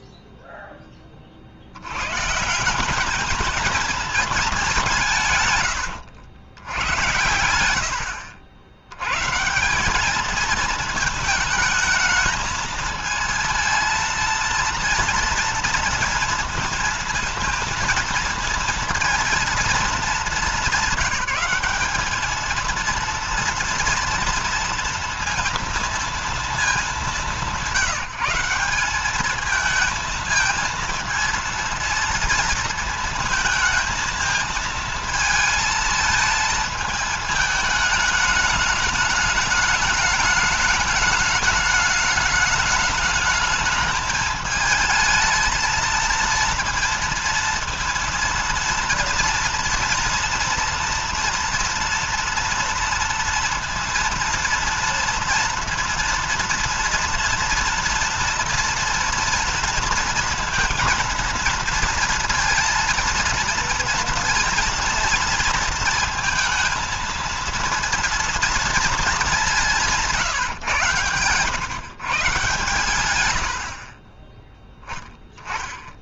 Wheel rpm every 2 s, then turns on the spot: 0, 170, 210, 100, 90, 220, 220, 230, 230, 230, 210, 220, 230, 220, 190, 220, 230, 220, 220, 210, 210, 210, 220, 230, 230, 230, 230, 230, 240, 230, 230, 230, 230, 220, 230, 130, 120, 20.
none